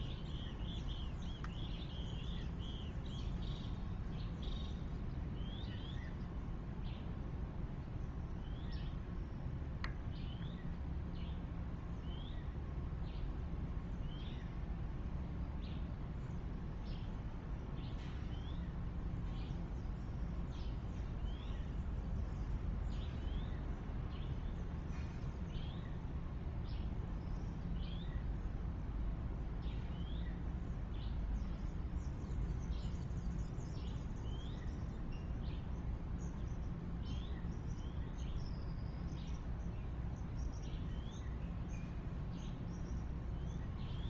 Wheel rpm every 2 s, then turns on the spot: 0, 0, 0, 0, 0, 0, 0, 0, 0, 0, 0, 0, 0, 0, 0, 0, 0, 0, 0, 0, 0, 0.
none